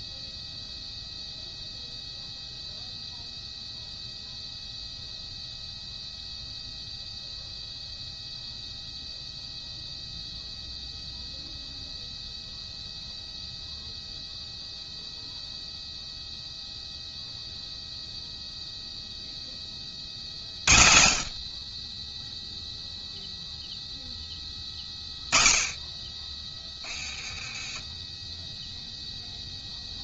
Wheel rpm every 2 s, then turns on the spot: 0, 0, 0, 0, 0, 0, 0, 0, 0, 0, 30, 10, 10, 20, 10.
none